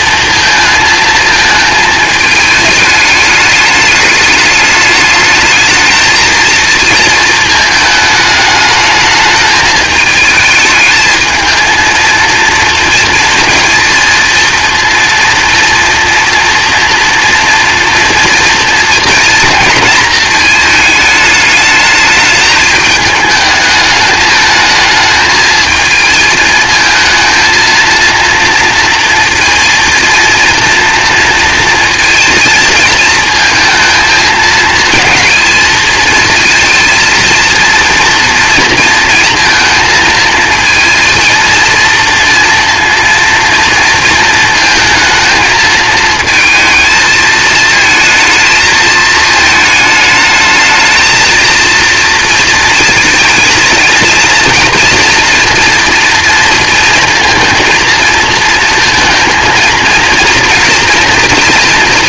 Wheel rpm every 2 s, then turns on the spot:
220, 210, 210, 220, 210, 220, 230, 230, 230, 230, 210, 220, 220, 220, 230, 230, 220, 220, 230, 230, 230, 230, 220, 220, 220, 220, 220, 240, 230, 230, 230.
none